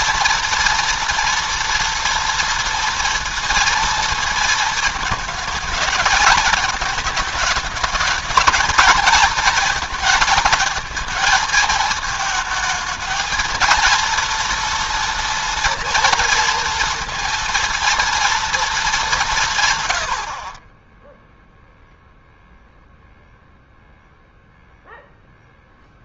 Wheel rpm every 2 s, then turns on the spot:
230, 230, 220, 210, 220, 230, 220, 230, 230, 210, 10, 0, 0.
none